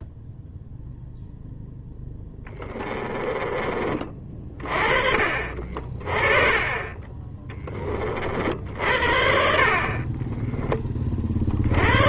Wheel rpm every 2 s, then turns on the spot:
0, 20, 40, 20, 60, 20.
2-4